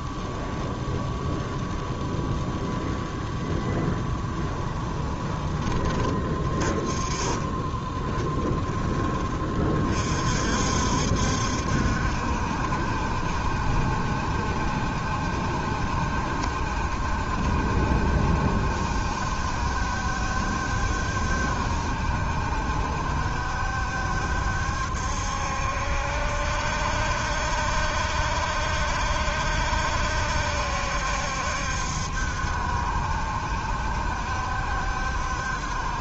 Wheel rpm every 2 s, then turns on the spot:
0, 0, 10, 30, 10, 50, 70, 70, 70, 70, 70, 70, 70, 70, 70, 70, 70, 70.
4-6